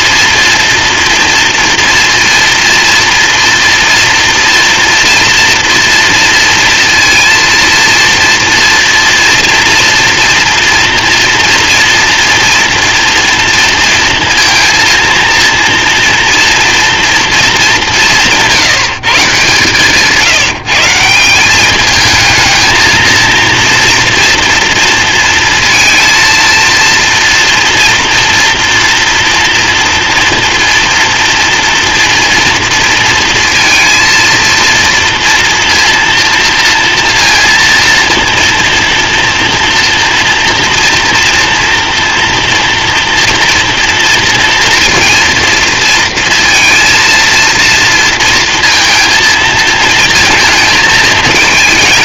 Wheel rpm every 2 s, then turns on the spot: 230, 240, 240, 230, 230, 230, 230, 230, 230, 150, 170, 230, 230, 230, 230, 230, 230, 230, 230, 230, 230, 230, 230, 230, 230, 220.
none